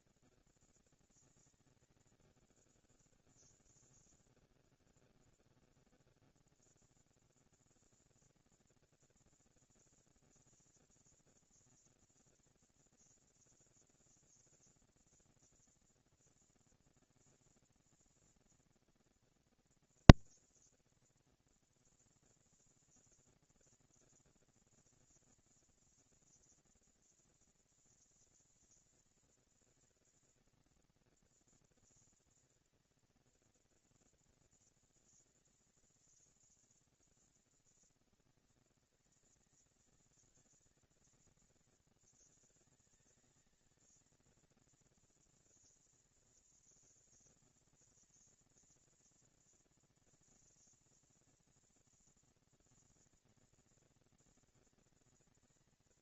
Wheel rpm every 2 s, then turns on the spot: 220, 200, 160, 160, 210, 230, 230, 230, 230, 230, 230, 230, 230, 230, 230, 230, 220, 230, 220, 190, 190, 190, 210, 230, 230, 230, 230, 230.
none